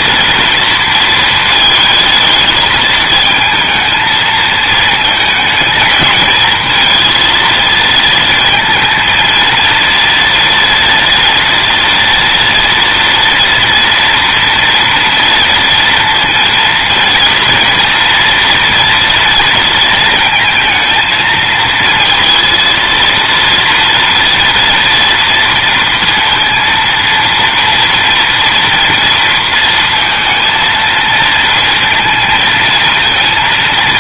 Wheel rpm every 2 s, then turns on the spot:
230, 220, 220, 220, 220, 230, 230, 230, 230, 240, 230, 230, 230, 230, 230, 230, 230.
none